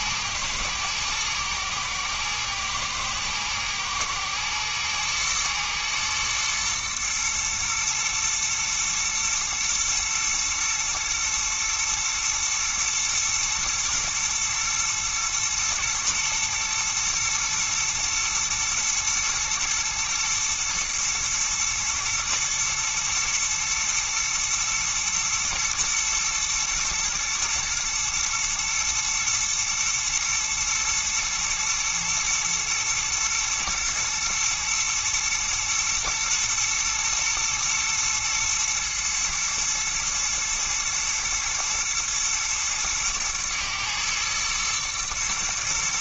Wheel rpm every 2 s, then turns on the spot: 110, 110, 120, 110, 120, 120, 120, 110, 120, 120, 110, 110, 110, 110, 120, 120, 120, 120, 120, 110, 110, 110, 110.
none